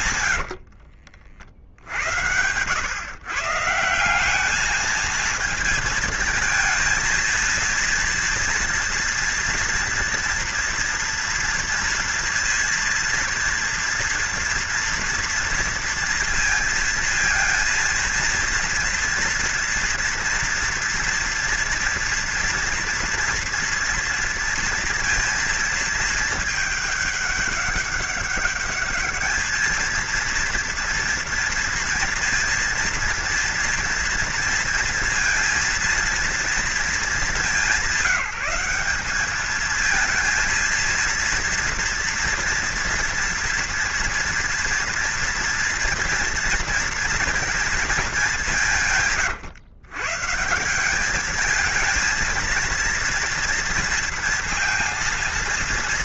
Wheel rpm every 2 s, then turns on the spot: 70, 100, 210, 230, 230, 230, 230, 230, 230, 230, 230, 230, 230, 210, 200, 230, 230, 230, 230, 180, 230, 240, 240, 230, 180, 160, 230, 230.
0-2